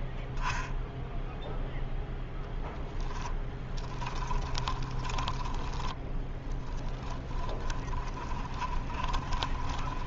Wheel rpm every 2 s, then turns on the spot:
0, 0, 10, 20, 20.
4-10